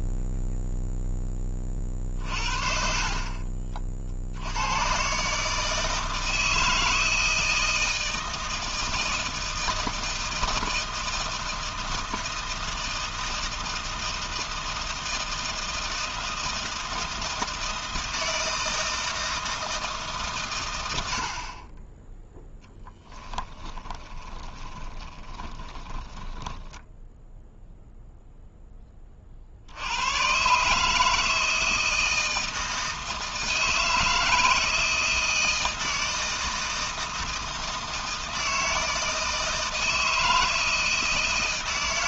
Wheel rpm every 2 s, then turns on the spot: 0, 40, 100, 160, 160, 160, 160, 160, 160, 160, 120, 10, 20, 10, 10, 140, 160, 160, 160, 160, 170.
24-28